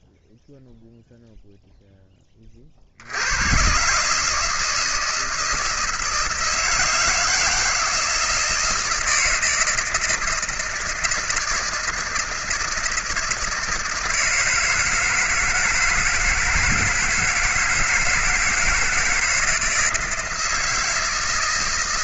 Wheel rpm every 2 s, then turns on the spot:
0, 40, 160, 160, 170, 160, 170, 160, 160, 160, 160.
none